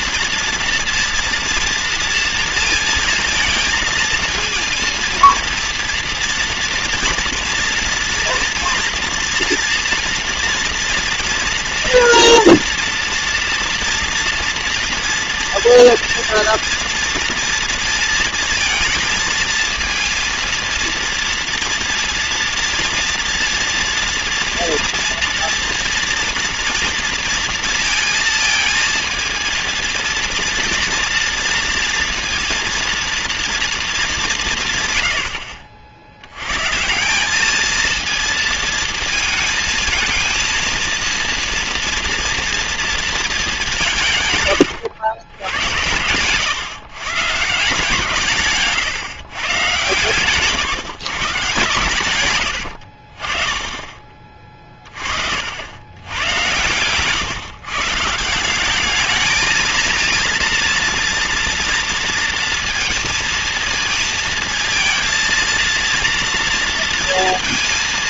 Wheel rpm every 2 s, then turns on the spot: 230, 230, 220, 230, 230, 230, 240, 230, 230, 230, 230, 230, 240, 240, 230, 230, 230, 160, 120, 220, 230, 230, 110, 130, 140, 150, 80, 40, 110, 190, 230, 230, 220, 230.
44-46 48-50 52-54